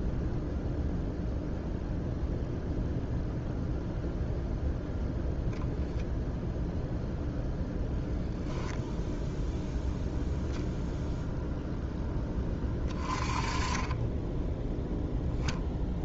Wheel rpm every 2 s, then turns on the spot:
0, 0, 0, 0, 0, 0, 20, 0.
none